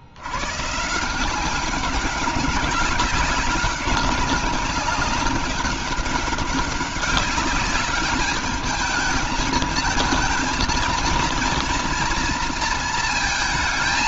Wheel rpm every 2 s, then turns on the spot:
140, 190, 200, 200, 210, 230, 230.
none